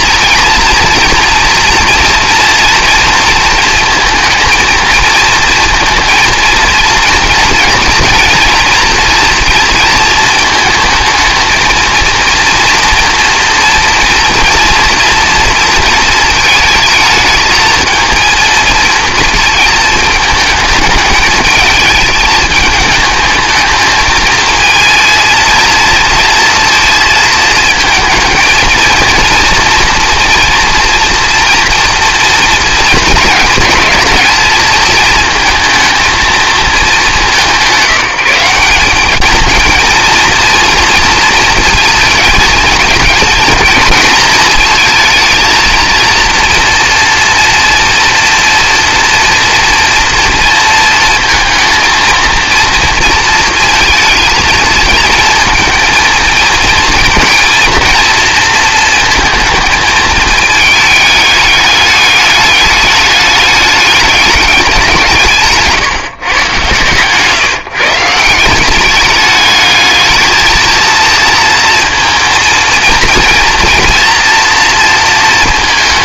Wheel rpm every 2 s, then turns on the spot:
230, 230, 230, 230, 230, 220, 230, 230, 220, 220, 210, 220, 220, 230, 230, 230, 230, 230, 210, 190, 230, 220, 220, 230, 230, 220, 230, 230, 230, 230, 210, 210, 180, 130, 190, 230, 230, 230.
66-68